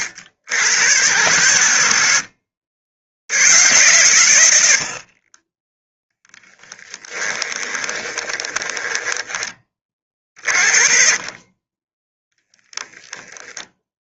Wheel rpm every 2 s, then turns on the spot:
120, 100, 30, 10, 10, 30, 0.
6-10